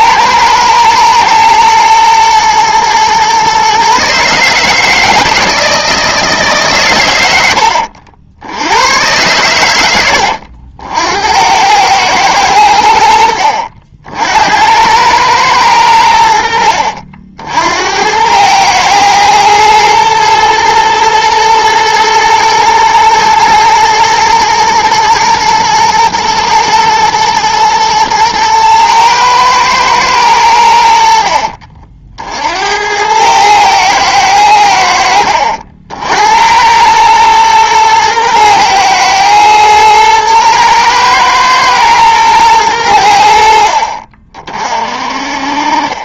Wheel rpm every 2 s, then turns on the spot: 110, 120, 160, 140, 90, 70, 100, 80, 70, 110, 120, 110, 120, 110, 110, 80, 80, 90, 90, 110, 110, 100, 40.
none